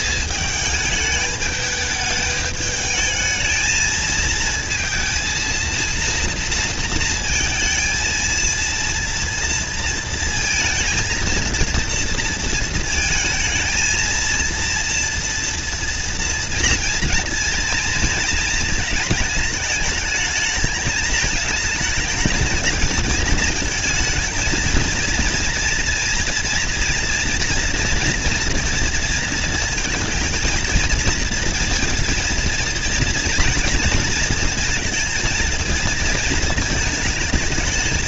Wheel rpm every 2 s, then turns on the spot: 200, 210, 220, 230, 230, 230, 230, 230, 230, 220, 220, 220, 220, 240, 240, 230, 230, 230, 230.
none